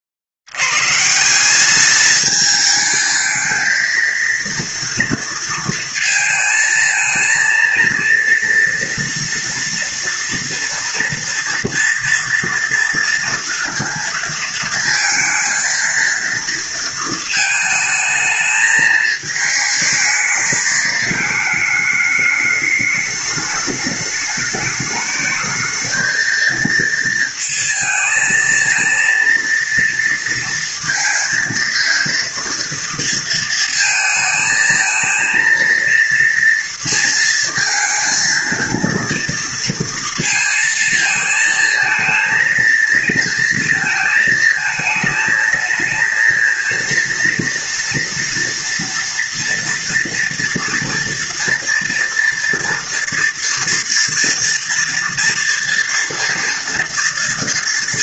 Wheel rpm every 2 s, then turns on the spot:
60, 220, 230, 220, 230, 230, 230, 230, 230, 220, 220, 210, 210, 220, 230, 230, 230, 220, 230, 230, 230, 230, 220, 230, 230, 240, 230, 230, 230.
none